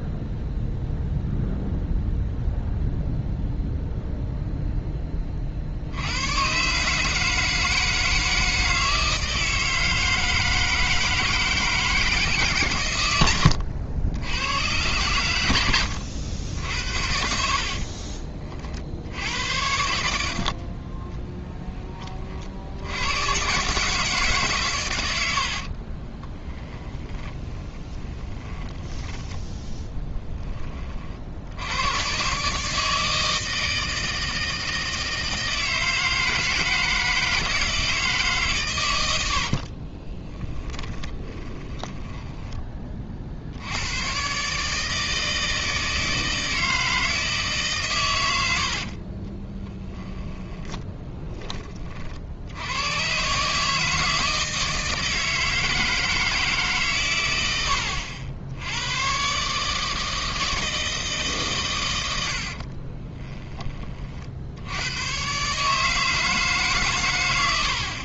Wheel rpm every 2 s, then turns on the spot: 0, 0, 0, 140, 160, 160, 130, 110, 70, 60, 20, 90, 120, 20, 20, 30, 150, 160, 160, 110, 10, 30, 150, 160, 70, 10, 110, 160, 150, 90, 160, 30, 100, 140.
20-22 26-28 40-42 48-52 62-64